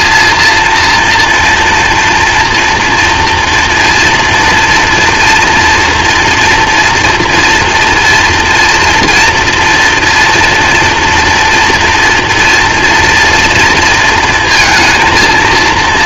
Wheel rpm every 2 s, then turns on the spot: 230, 230, 230, 240, 240, 230, 230, 230.
none